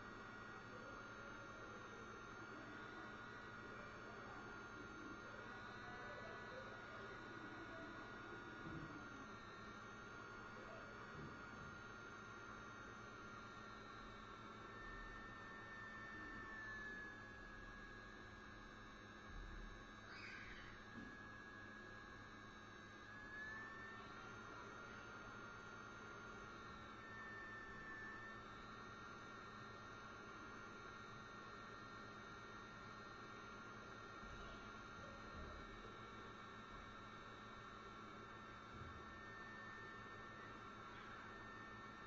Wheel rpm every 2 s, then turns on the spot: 0, 0, 0, 0, 0, 0, 0, 0, 0, 0, 0, 0, 0, 0, 0, 0, 0, 0, 0, 0, 0.
none